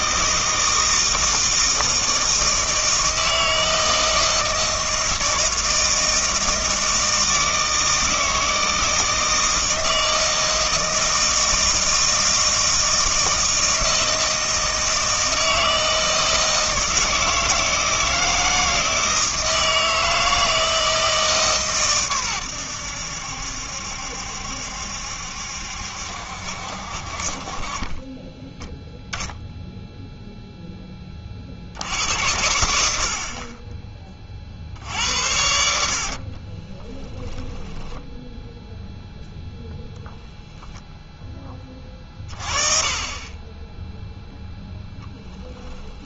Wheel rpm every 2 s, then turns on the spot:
160, 160, 160, 160, 160, 160, 160, 160, 160, 160, 160, 90, 70, 60, 10, 10, 70, 70, 30, 0, 0, 30, 0.
36-38